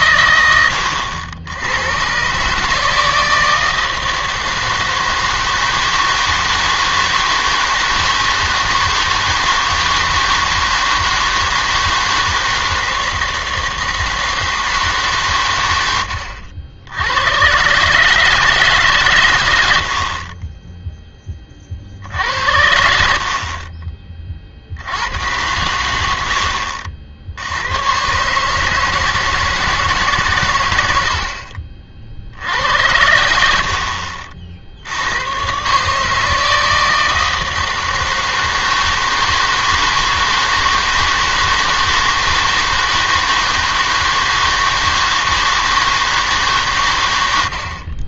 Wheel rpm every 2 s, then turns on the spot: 100, 150, 160, 160, 160, 160, 160, 160, 80, 150, 20, 70, 60, 60, 150, 110, 80, 70, 160, 160, 160, 160, 160, 130.
none